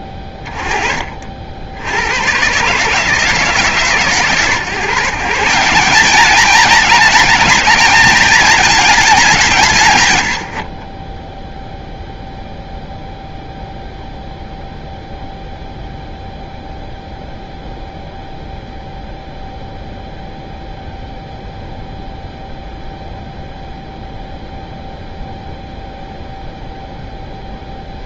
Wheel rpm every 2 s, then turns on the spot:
20, 140, 140, 220, 220, 50, 0, 0, 0, 0, 0, 0, 0, 0.
none